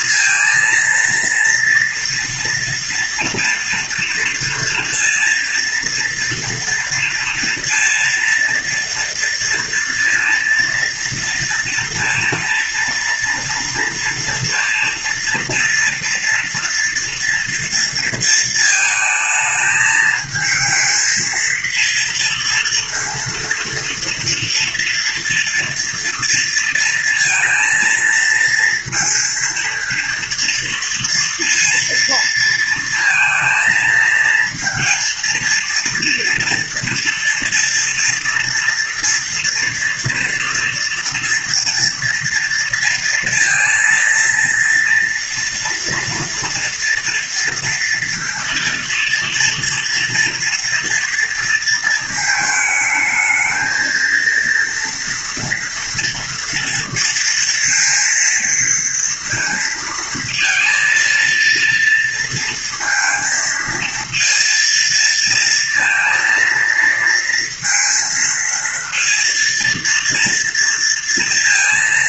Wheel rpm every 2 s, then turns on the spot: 230, 230, 230, 230, 230, 230, 230, 230, 230, 220, 220, 230, 230, 230, 230, 230, 230, 230, 230, 230, 230, 230, 230, 230, 230, 240, 220, 230, 230, 230, 230, 230, 230, 230, 230, 230.
none